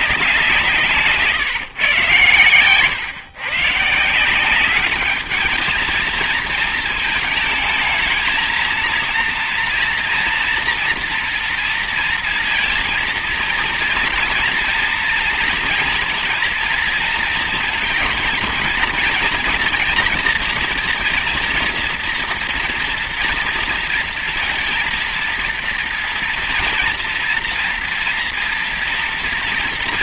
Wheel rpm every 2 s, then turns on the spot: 160, 130, 210, 220, 230, 240, 230, 230, 230, 230, 230, 230, 230, 230, 230.
none